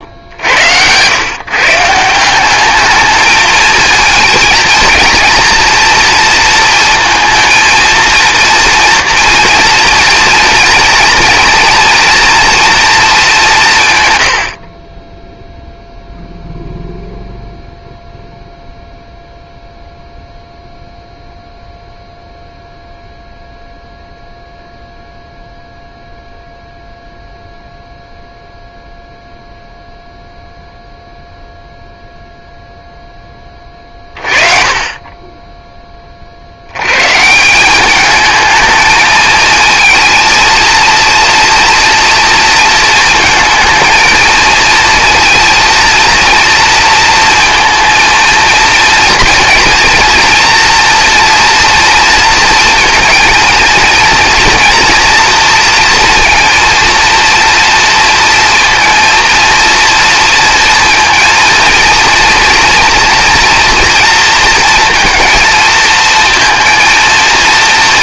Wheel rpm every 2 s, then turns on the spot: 100, 210, 230, 230, 230, 230, 230, 30, 0, 0, 0, 0, 0, 0, 0, 0, 0, 30, 90, 220, 230, 230, 230, 230, 230, 240, 230, 230, 230, 230, 230, 230, 230, 230.
none